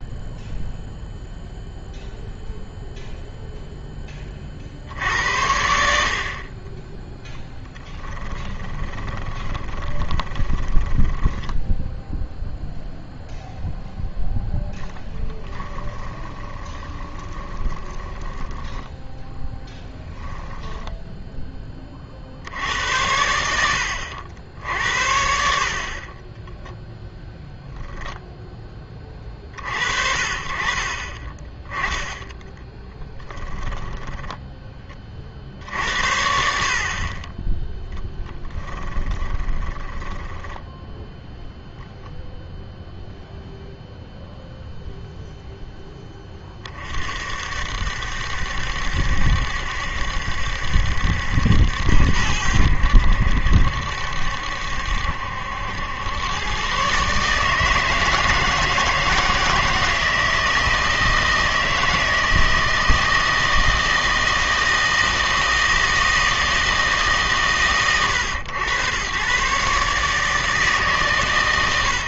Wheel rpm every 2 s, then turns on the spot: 0, 0, 70, 0, 20, 10, 0, 10, 20, 10, 10, 80, 60, 10, 40, 20, 10, 50, 20, 20, 0, 0, 0, 50, 70, 70, 70, 70, 140, 160, 160, 160, 160, 140, 120, 140.
8-12 14-20 32-34 38-40